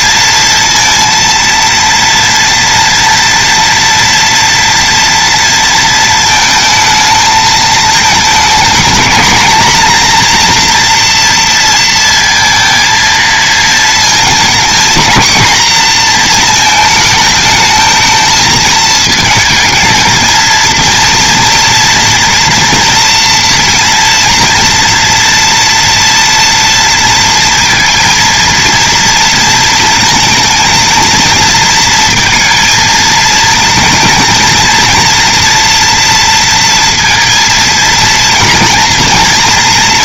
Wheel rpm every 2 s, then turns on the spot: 230, 230, 230, 220, 230, 240, 230, 230, 220, 220, 230, 230, 230, 230, 230, 230, 230, 230, 230, 230.
none